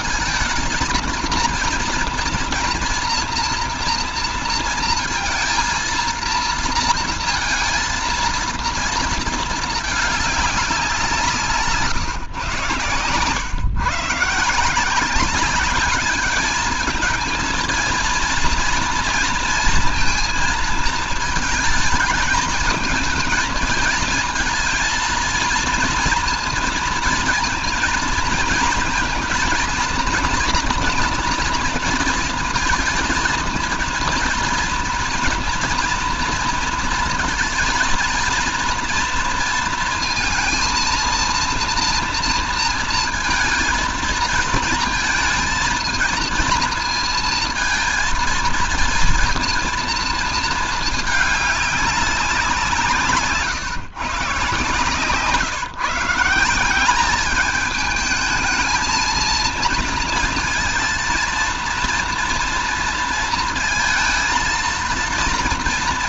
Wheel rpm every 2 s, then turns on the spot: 230, 240, 230, 230, 230, 200, 110, 160, 220, 230, 230, 220, 230, 230, 230, 230, 230, 230, 230, 230, 230, 230, 220, 230, 230, 220, 170, 140, 180, 220, 230, 230, 230.
none